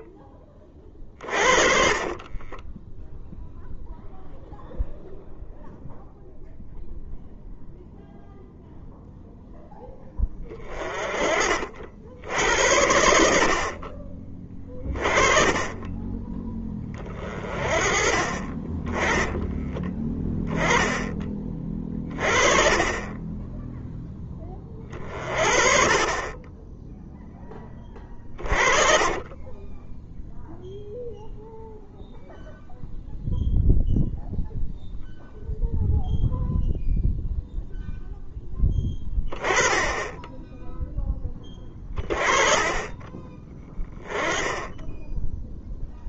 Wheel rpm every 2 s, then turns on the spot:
30, 10, 0, 0, 0, 20, 70, 20, 20, 20, 20, 30, 20, 10, 40, 0, 0, 0, 0, 10, 10, 20, 10.
2-4 28-30